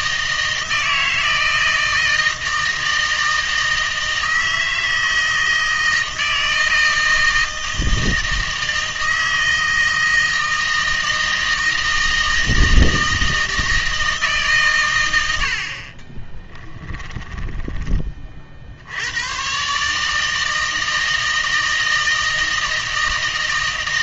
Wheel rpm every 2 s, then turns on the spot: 160, 160, 160, 160, 160, 160, 160, 130, 20, 70, 160, 160.
16-18